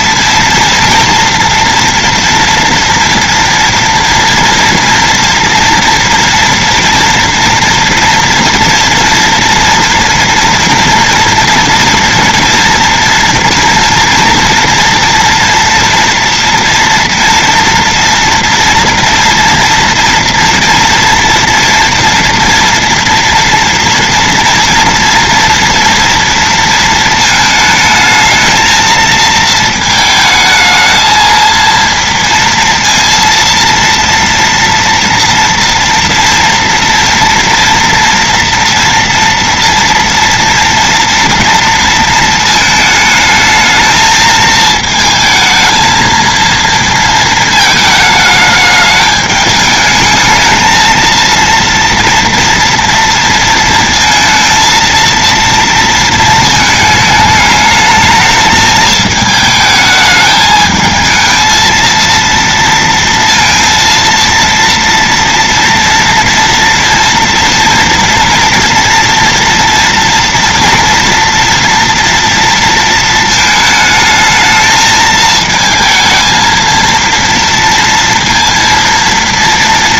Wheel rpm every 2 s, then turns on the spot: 230, 230, 230, 230, 240, 240, 230, 230, 230, 230, 240, 230, 230, 230, 220, 220, 230, 230, 230, 230, 230, 230, 220, 220, 220, 220, 240, 230, 220, 210, 220, 230, 230, 230, 230, 230, 230, 220, 220, 230.
none